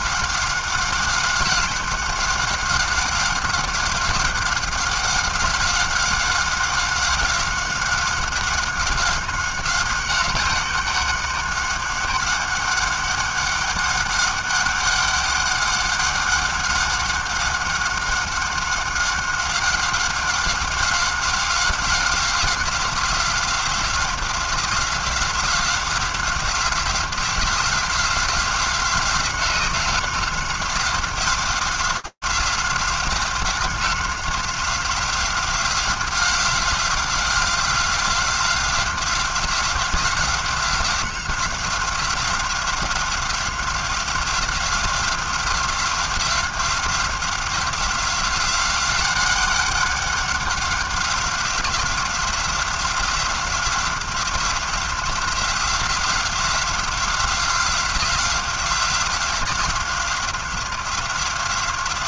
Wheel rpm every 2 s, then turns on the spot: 190, 200, 190, 190, 190, 190, 200, 200, 190, 190, 190, 190, 180, 180, 180, 180, 190, 180, 180, 180, 180, 180, 180, 180, 190, 190, 180, 180, 180, 180, 180.
none